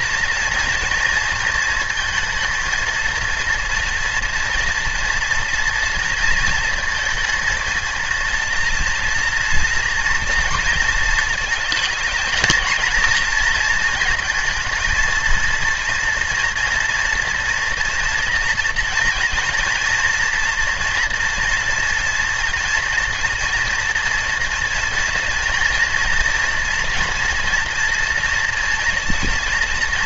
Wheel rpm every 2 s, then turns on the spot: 230, 230, 230, 230, 230, 230, 230, 220, 230, 230, 230, 230, 240, 230, 230.
none